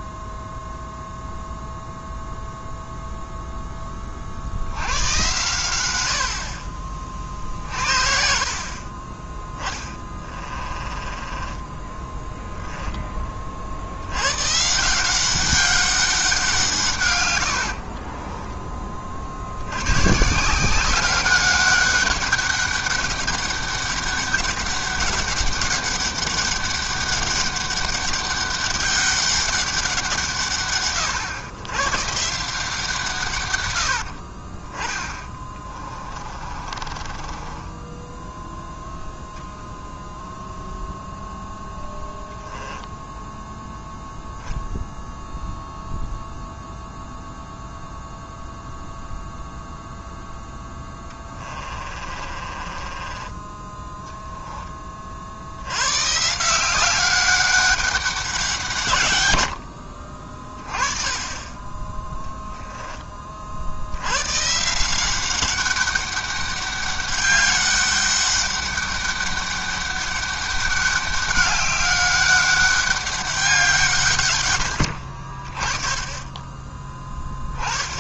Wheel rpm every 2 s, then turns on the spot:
0, 0, 80, 40, 40, 20, 10, 170, 150, 30, 180, 200, 200, 200, 200, 120, 160, 20, 30, 0, 0, 0, 0, 0, 0, 10, 20, 30, 190, 140, 20, 20, 170, 200, 200, 200, 200, 80, 10.
10-12 36-38 50-54